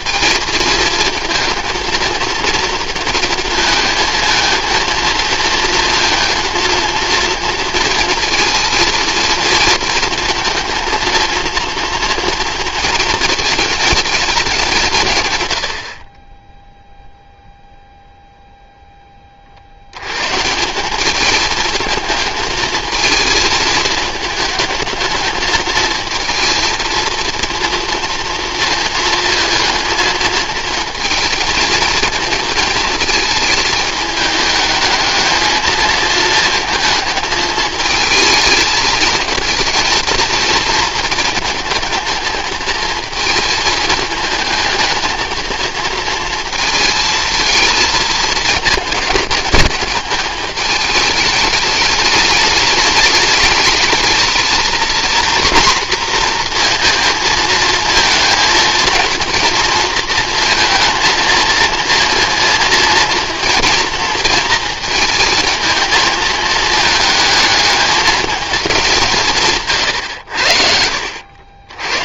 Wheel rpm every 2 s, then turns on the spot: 230, 230, 230, 230, 230, 230, 230, 180, 0, 0, 180, 220, 220, 230, 230, 230, 220, 210, 220, 220, 230, 230, 220, 230, 220, 210, 210, 240, 230, 230, 230, 230, 230, 220, 200, 70.
none